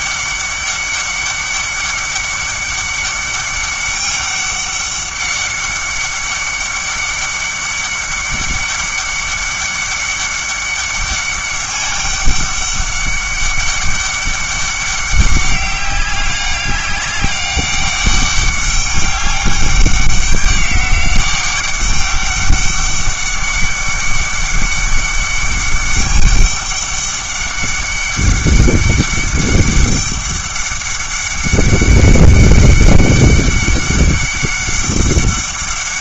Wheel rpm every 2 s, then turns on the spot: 200, 200, 200, 200, 200, 200, 200, 200, 200, 200, 190, 200, 200, 200, 200, 200, 200, 200.
none